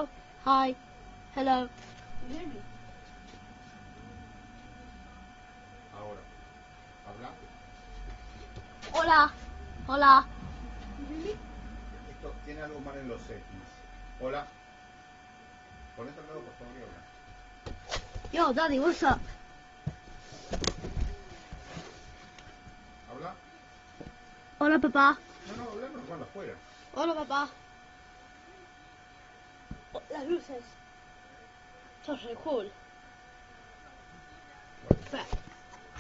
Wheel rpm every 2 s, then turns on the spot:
0, 0, 0, 0, 0, 0, 0, 0, 0, 0, 0, 0, 0, 0, 0, 0, 0, 0.
none